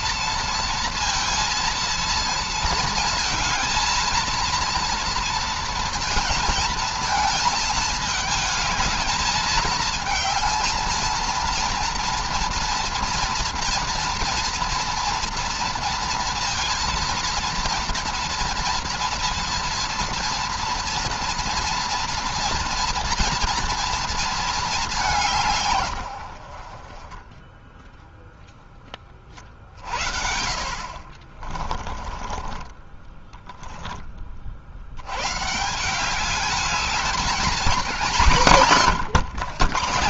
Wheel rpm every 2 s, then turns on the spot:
230, 230, 230, 230, 220, 220, 230, 230, 230, 240, 230, 230, 220, 60, 0, 60, 20, 50, 200, 170.
32-34 38-40